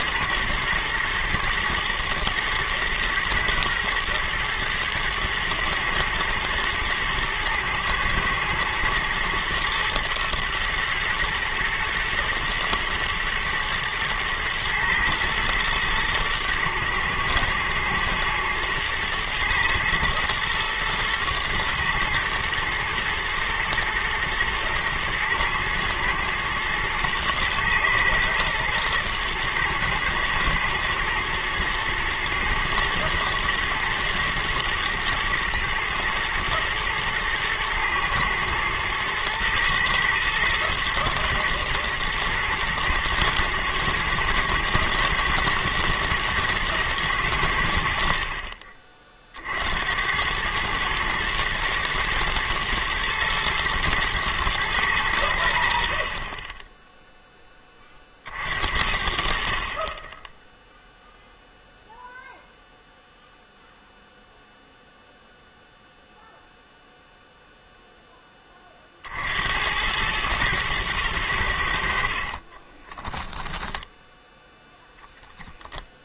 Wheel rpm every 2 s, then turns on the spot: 110, 120, 110, 120, 120, 120, 110, 110, 110, 110, 120, 110, 110, 110, 110, 120, 110, 120, 110, 110, 110, 110, 110, 110, 40, 110, 110, 110, 10, 60, 0, 0, 0, 0, 30, 110, 20, 10.
72-74